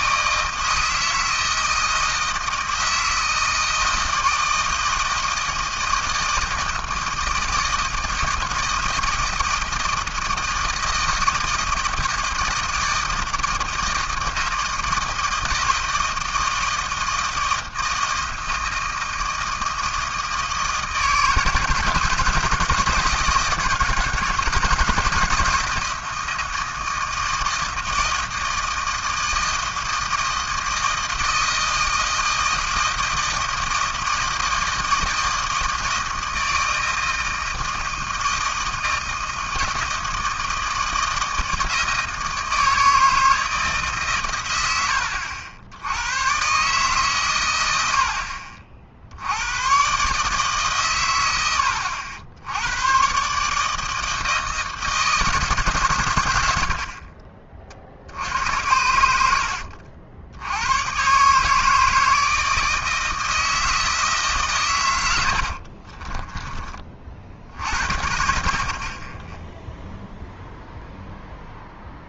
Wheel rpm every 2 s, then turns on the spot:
160, 160, 160, 160, 160, 160, 160, 160, 160, 160, 160, 160, 160, 160, 160, 160, 160, 160, 160, 160, 160, 160, 100, 140, 50, 150, 90, 160, 80, 80, 90, 160, 130, 30, 50, 0.
none